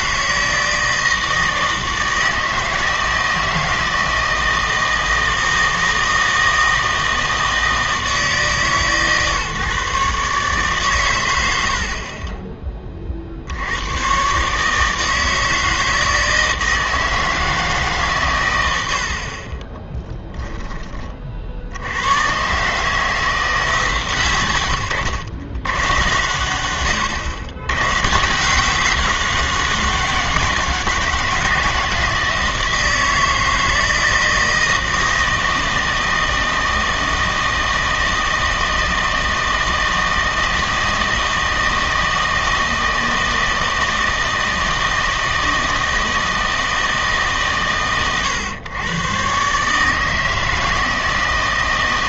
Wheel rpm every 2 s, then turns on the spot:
160, 160, 160, 160, 140, 130, 20, 150, 160, 90, 20, 140, 100, 100, 180, 180, 160, 160, 160, 160, 160, 160, 160, 160, 120, 160.
18-20